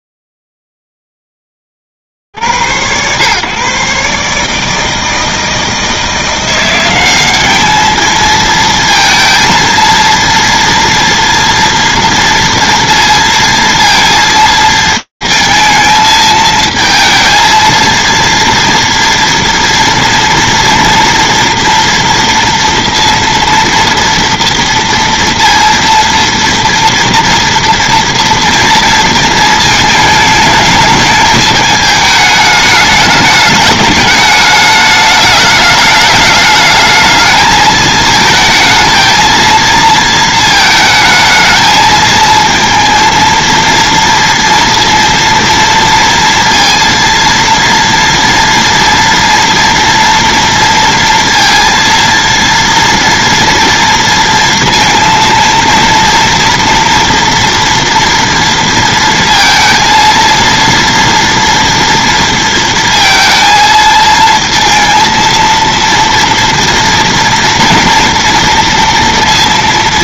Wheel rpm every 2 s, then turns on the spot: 0, 30, 140, 160, 210, 230, 230, 230, 220, 230, 230, 230, 230, 230, 230, 220, 210, 210, 210, 220, 230, 220, 230, 230, 230, 230, 230, 230, 230, 230, 230, 230, 230, 230, 230.
none